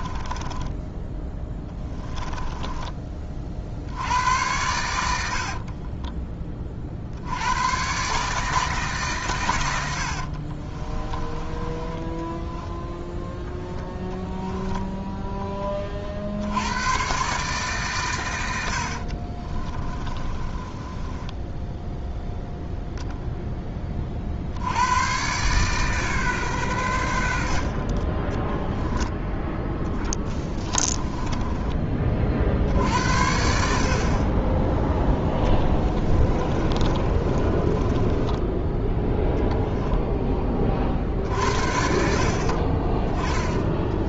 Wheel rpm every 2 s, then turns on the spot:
10, 20, 90, 40, 150, 40, 10, 10, 90, 70, 20, 0, 80, 110, 10, 10, 60, 10, 30, 10, 40, 40.
0-4 10-12 14-16 18-22 30-32 36-38